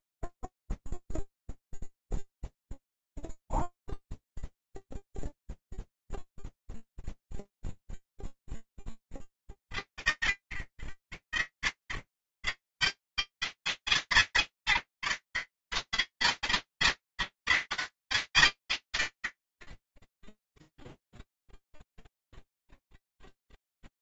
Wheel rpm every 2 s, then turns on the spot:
0, 0, 0, 0, 0, 30, 120, 160, 160, 140, 10, 0.
20-22